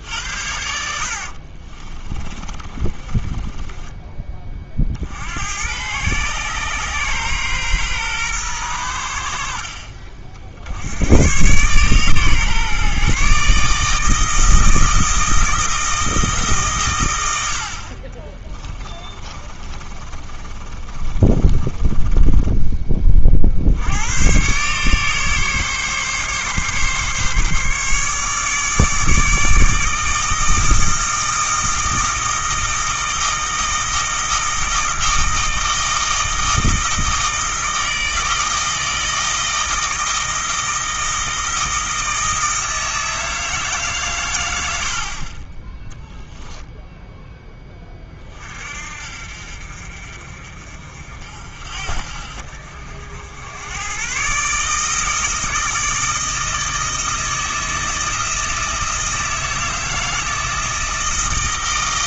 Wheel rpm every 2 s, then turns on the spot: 60, 30, 60, 130, 90, 100, 140, 160, 120, 20, 20, 30, 140, 140, 150, 160, 160, 160, 160, 160, 160, 160, 50, 0, 50, 50, 60, 150, 160, 160, 160.
0-4 18-22